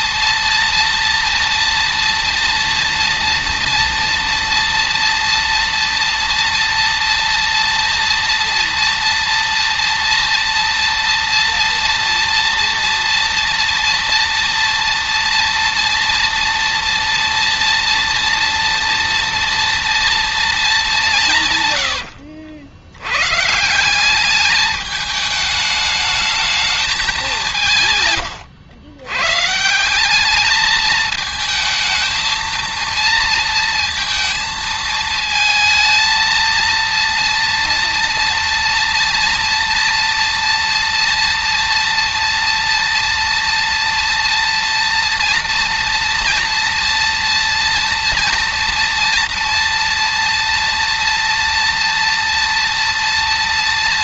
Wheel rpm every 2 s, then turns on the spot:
230, 230, 230, 230, 230, 230, 230, 230, 230, 230, 220, 80, 210, 210, 100, 210, 230, 220, 230, 230, 230, 230, 230, 230, 230, 230, 230.
none